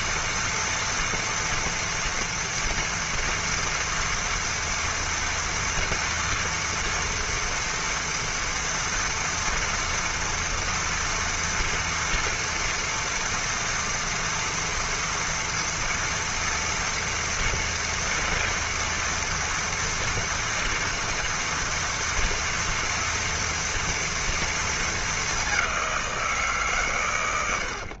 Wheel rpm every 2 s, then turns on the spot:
230, 230, 230, 230, 230, 230, 230, 230, 230, 230, 230, 230, 230, 160.
none